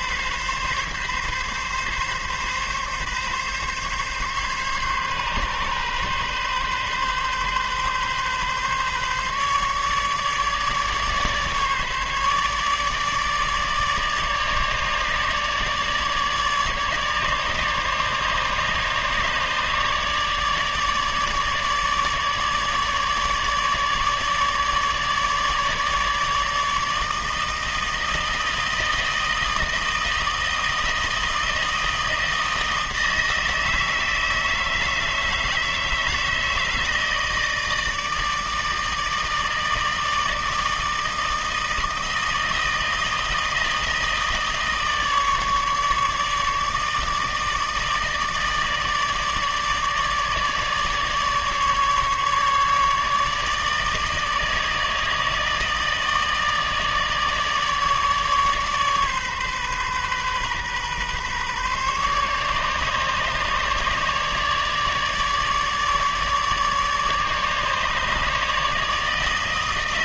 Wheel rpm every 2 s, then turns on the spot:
140, 140, 140, 130, 140, 150, 150, 150, 150, 150, 150, 150, 150, 150, 160, 160, 160, 160, 160, 160, 160, 160, 160, 150, 160, 150, 150, 160, 160, 140, 130, 150, 150, 150, 150.
none